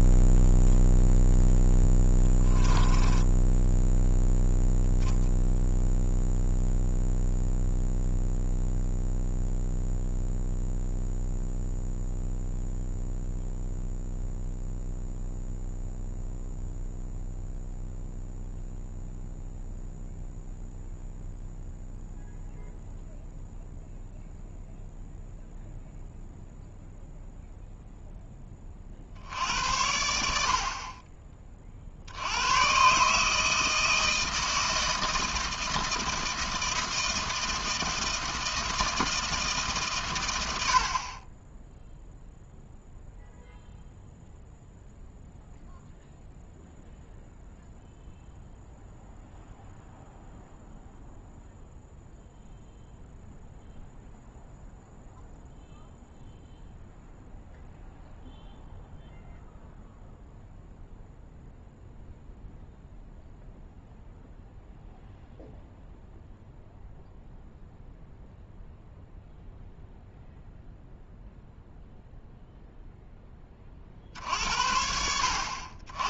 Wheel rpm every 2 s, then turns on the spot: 0, 10, 0, 0, 0, 0, 0, 0, 0, 0, 0, 0, 0, 0, 30, 50, 110, 160, 160, 160, 80, 0, 0, 0, 0, 0, 0, 0, 0, 0, 0, 0, 0, 0, 0, 0, 0, 70.
2-4